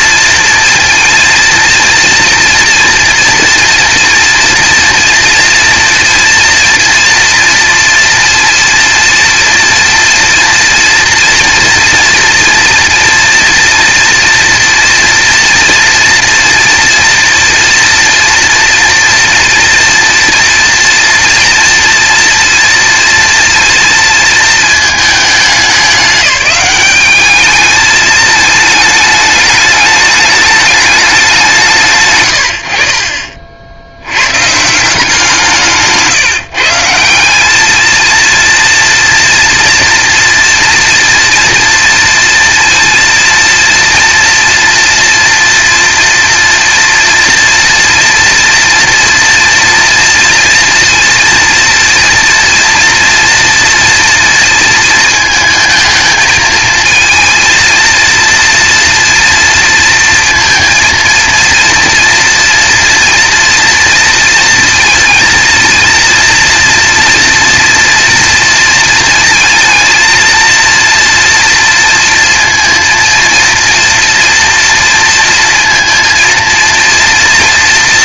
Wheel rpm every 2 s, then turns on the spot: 230, 230, 230, 230, 230, 230, 230, 230, 230, 230, 230, 230, 220, 200, 210, 210, 80, 140, 150, 230, 230, 230, 230, 240, 230, 230, 230, 230, 220, 230, 230, 230, 230, 230, 230, 230, 230, 230, 230.
none